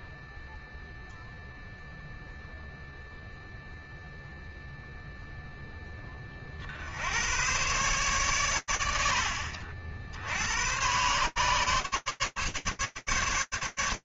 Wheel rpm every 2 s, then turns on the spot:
0, 0, 0, 90, 90, 120, 140.
none